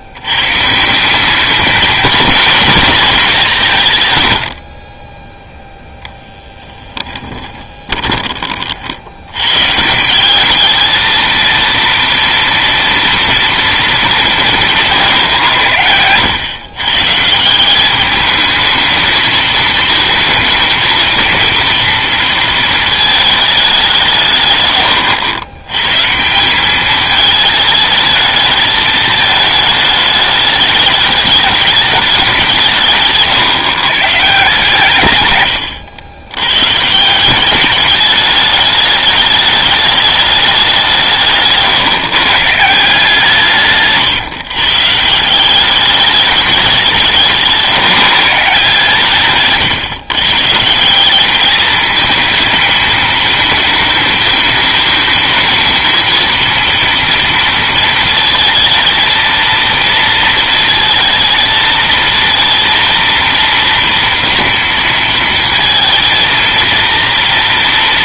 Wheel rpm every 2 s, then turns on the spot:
130, 220, 70, 10, 40, 210, 230, 150, 110, 210, 230, 220, 120, 190, 220, 210, 170, 150, 120, 210, 190, 160, 140, 190, 150, 150, 220, 220, 230, 230, 220, 230, 230, 230.
6-8